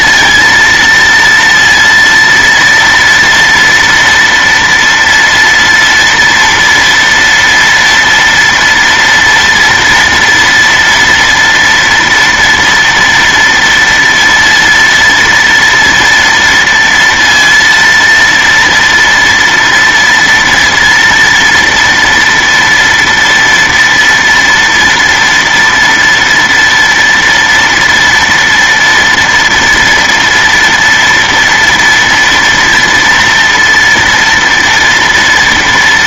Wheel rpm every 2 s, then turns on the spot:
230, 230, 230, 240, 230, 230, 230, 230, 230, 230, 240, 230, 240, 230, 230, 230, 230, 230.
none